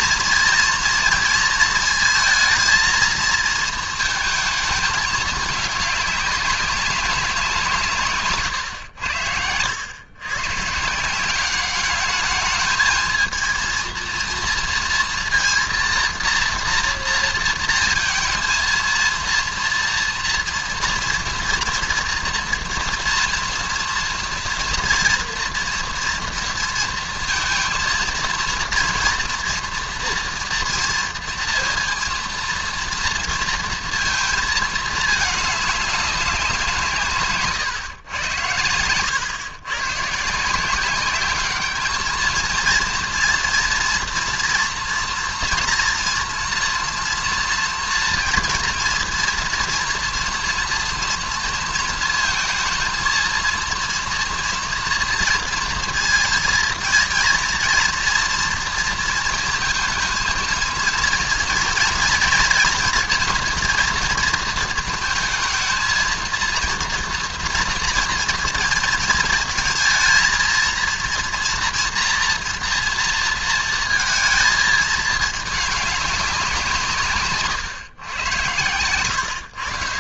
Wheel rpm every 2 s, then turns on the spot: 230, 220, 220, 190, 100, 140, 220, 230, 230, 230, 240, 240, 230, 230, 230, 230, 230, 220, 170, 100, 180, 230, 230, 230, 230, 230, 230, 230, 230, 230, 230, 230, 220, 230, 220, 230, 230, 220, 170, 130.
none